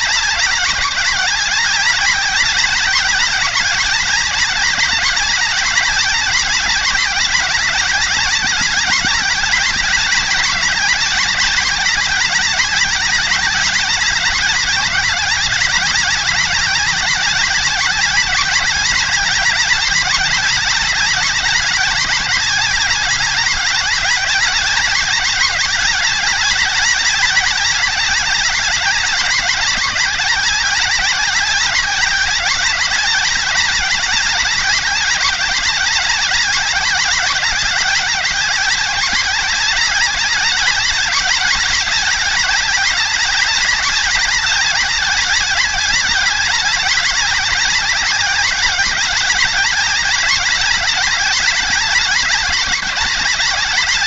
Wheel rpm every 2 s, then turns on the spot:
190, 200, 190, 190, 190, 190, 200, 190, 190, 190, 190, 190, 200, 190, 200, 190, 190, 190, 190, 200, 200, 190, 190, 190, 200, 190, 180.
none